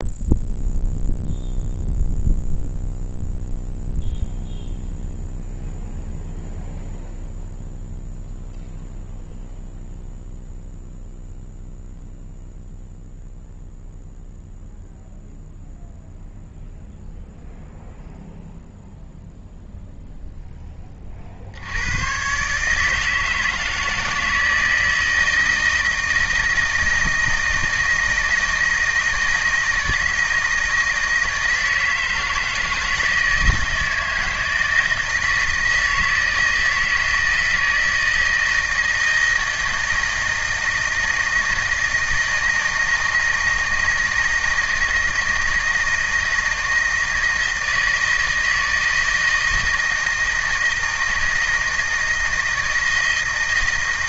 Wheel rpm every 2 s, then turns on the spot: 0, 0, 0, 0, 0, 0, 0, 0, 0, 0, 10, 150, 160, 160, 160, 160, 160, 160, 160, 160, 160, 160, 160, 160, 160, 160, 160.
none